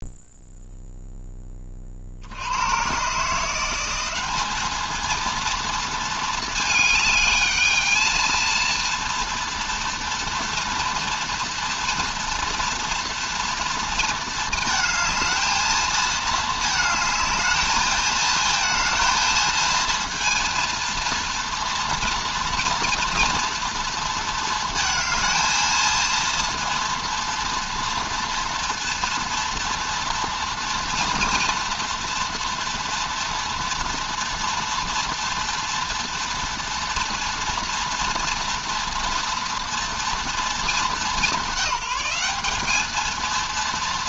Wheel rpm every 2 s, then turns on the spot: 0, 110, 220, 220, 230, 230, 230, 220, 220, 230, 230, 230, 220, 230, 230, 230, 240, 230, 240, 240, 220, 200.
none